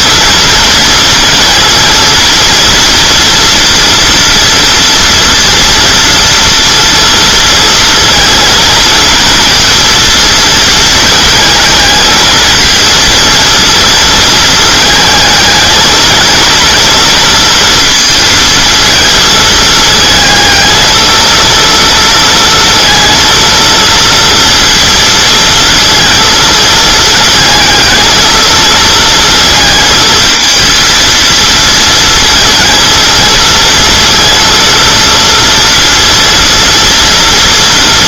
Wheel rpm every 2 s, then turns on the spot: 230, 230, 230, 230, 230, 230, 230, 220, 230, 230, 220, 230, 230, 230, 220, 230, 220, 230, 230.
none